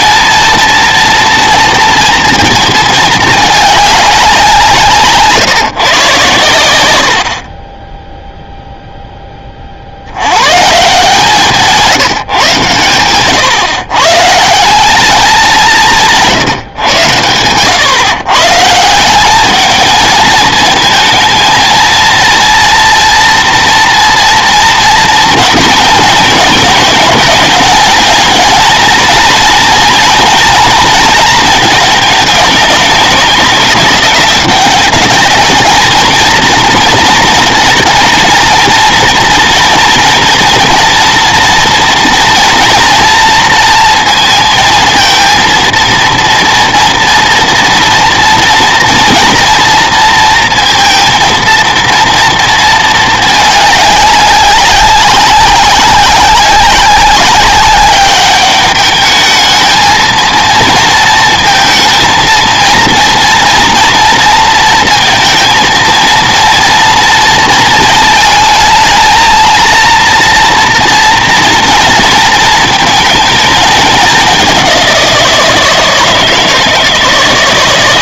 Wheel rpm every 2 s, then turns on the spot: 230, 220, 180, 100, 0, 150, 130, 180, 130, 150, 220, 230, 230, 210, 230, 230, 210, 200, 230, 230, 230, 230, 220, 230, 230, 230, 220, 190, 200, 210, 230, 230, 230, 230, 220, 230, 230, 190, 160.
none